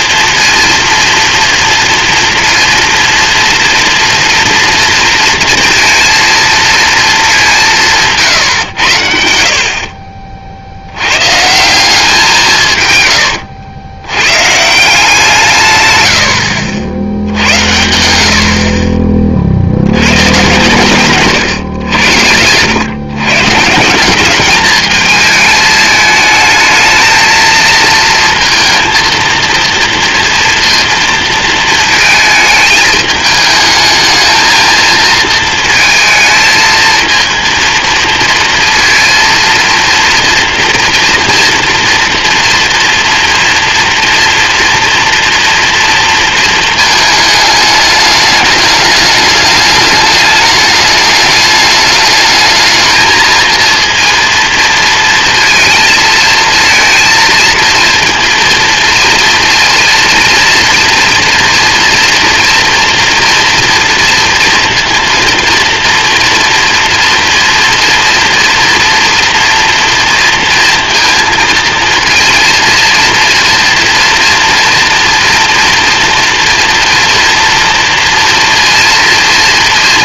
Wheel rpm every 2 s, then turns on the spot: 230, 230, 230, 220, 70, 90, 130, 170, 80, 40, 120, 130, 220, 220, 230, 230, 220, 230, 230, 230, 230, 230, 230, 220, 210, 210, 220, 220, 230, 230, 230, 230, 230, 230, 240, 230, 230, 230, 230, 230.
20-22